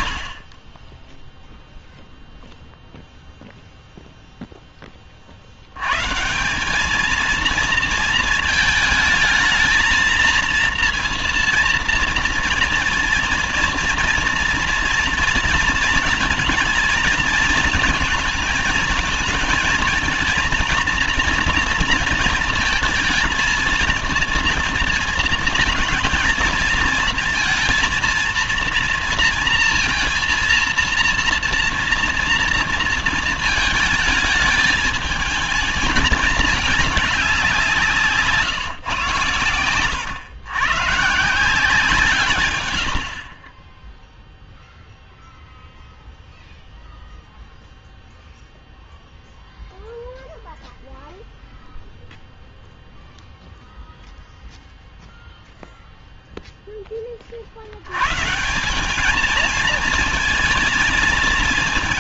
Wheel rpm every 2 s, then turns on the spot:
30, 0, 10, 180, 220, 230, 230, 230, 220, 220, 230, 230, 230, 220, 230, 230, 230, 220, 210, 130, 120, 120, 0, 0, 0, 0, 0, 0, 10, 170, 230.
none